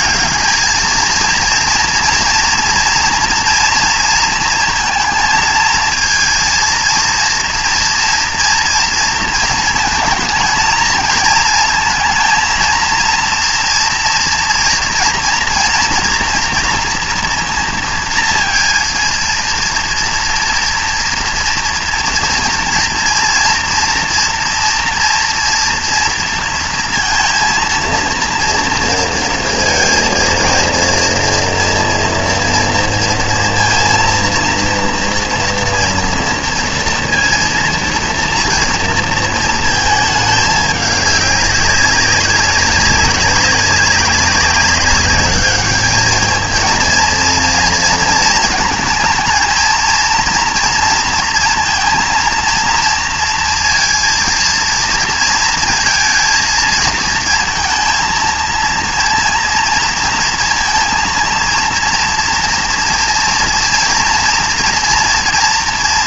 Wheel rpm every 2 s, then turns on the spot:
210, 230, 230, 230, 230, 230, 230, 240, 240, 230, 230, 230, 240, 230, 230, 230, 230, 230, 230, 230, 210, 200, 200, 220, 220, 240, 230, 230, 220, 230, 230, 230, 240.
none